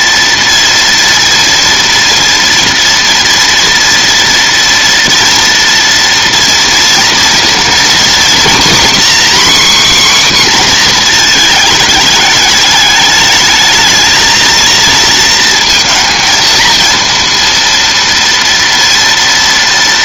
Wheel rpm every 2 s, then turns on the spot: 230, 230, 230, 230, 250, 260, 210, 230, 230, 230.
none